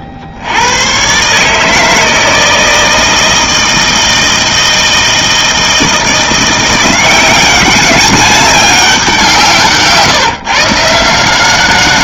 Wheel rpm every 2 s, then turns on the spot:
80, 160, 160, 170, 200, 130.
none